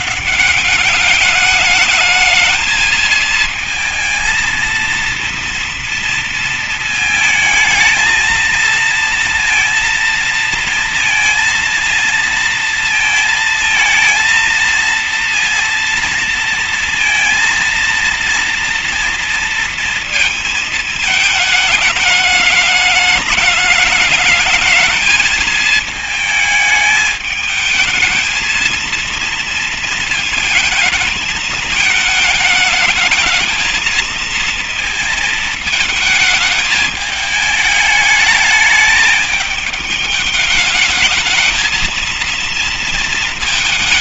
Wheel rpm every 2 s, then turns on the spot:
220, 230, 230, 230, 230, 230, 230, 230, 230, 220, 210, 220, 220, 230, 230, 220, 230, 220, 220, 210, 230, 210.
none